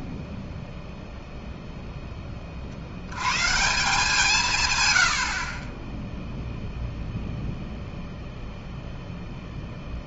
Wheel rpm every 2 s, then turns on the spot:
0, 40, 140, 0, 0.
none